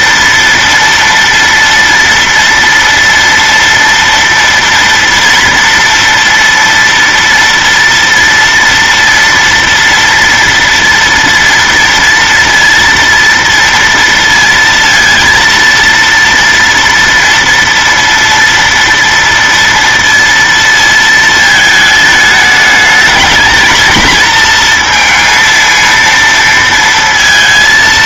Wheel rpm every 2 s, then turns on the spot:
230, 230, 230, 230, 230, 230, 230, 230, 230, 230, 230, 220, 230, 230.
none